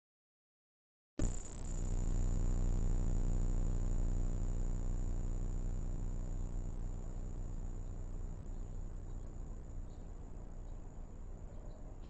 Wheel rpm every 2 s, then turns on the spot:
0, 0, 0, 0, 0, 0.
none